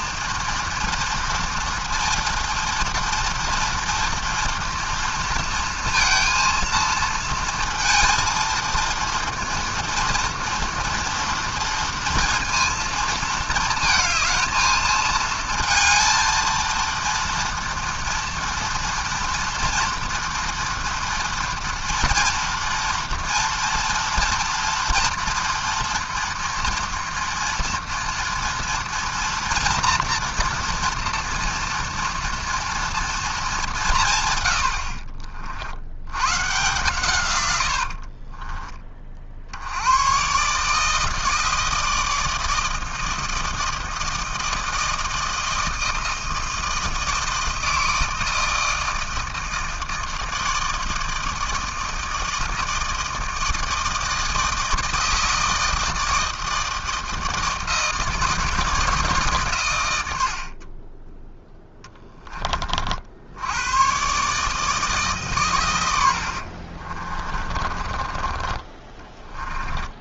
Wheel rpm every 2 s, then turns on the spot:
230, 230, 230, 230, 230, 230, 230, 220, 230, 230, 230, 240, 240, 230, 230, 230, 230, 90, 130, 20, 150, 160, 160, 160, 160, 160, 160, 160, 160, 160, 40, 40, 150, 50, 20.
66-68